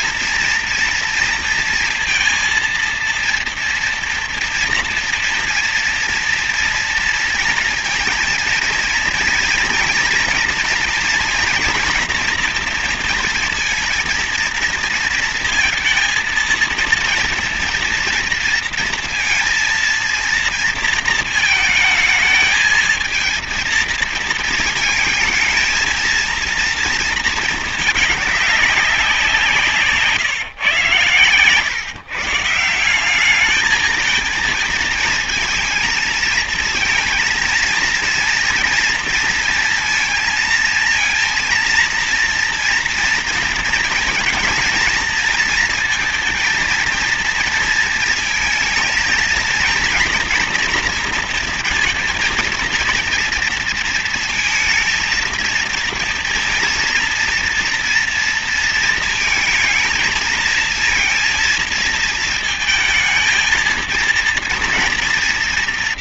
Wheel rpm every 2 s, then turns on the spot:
230, 230, 230, 230, 230, 230, 230, 230, 230, 230, 230, 220, 230, 230, 200, 120, 170, 230, 230, 230, 230, 240, 230, 230, 230, 230, 230, 230, 230, 230, 230, 220, 230.
none